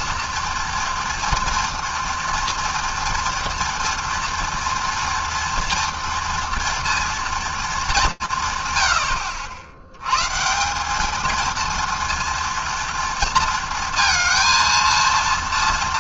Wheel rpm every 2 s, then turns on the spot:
230, 240, 230, 230, 160, 150, 230, 230.
none